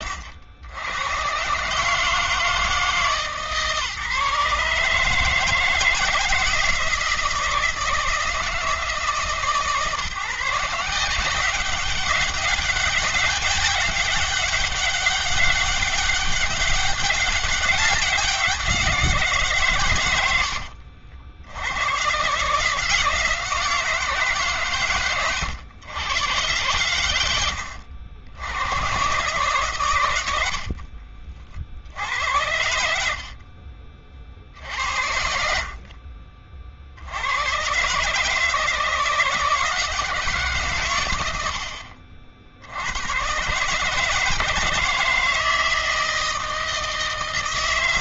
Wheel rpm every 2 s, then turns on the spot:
100, 150, 150, 170, 160, 170, 200, 200, 200, 180, 80, 160, 140, 120, 110, 60, 80, 60, 50, 160, 140, 70, 160, 160.
20-22 30-34